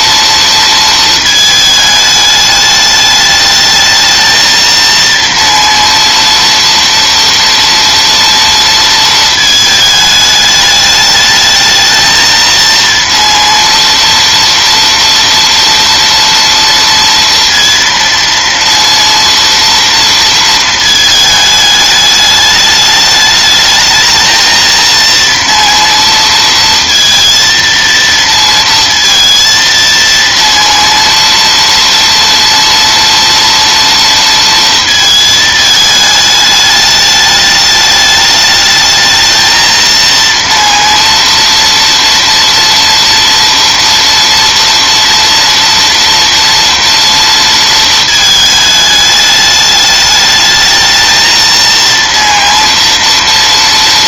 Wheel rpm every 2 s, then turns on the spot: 230, 210, 230, 230, 230, 210, 230, 230, 230, 230, 220, 210, 220, 230, 230, 230, 230, 230, 210, 210, 230, 230, 230, 240, 210, 210, 230.
none